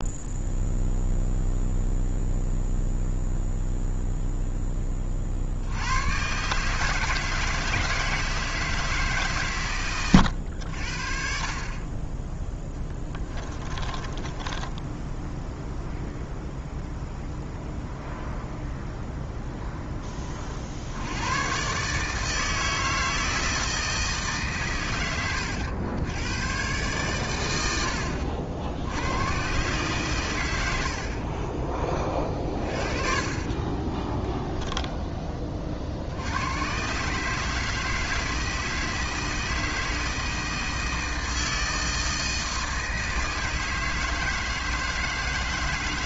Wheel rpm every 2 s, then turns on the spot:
0, 0, 0, 130, 160, 90, 10, 20, 0, 0, 40, 160, 140, 120, 80, 100, 30, 0, 100, 160, 160, 160, 160.
14-16 32-34